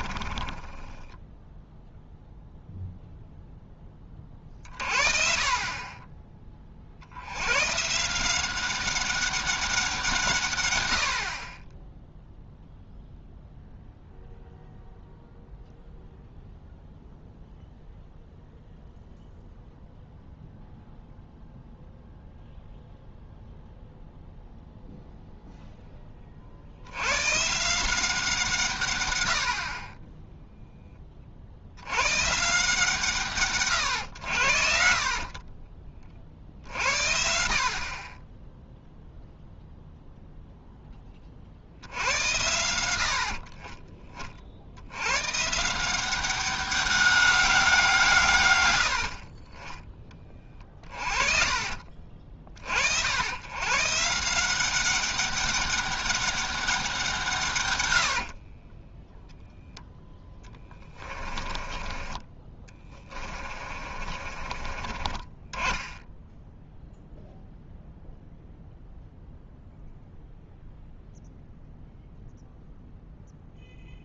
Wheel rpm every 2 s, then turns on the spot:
10, 0, 40, 40, 190, 90, 0, 0, 0, 0, 0, 0, 0, 90, 140, 0, 160, 60, 70, 0, 10, 90, 80, 190, 80, 30, 60, 190, 190, 20, 20, 20, 30, 0, 0, 0, 0.
0-2 50-52 58-66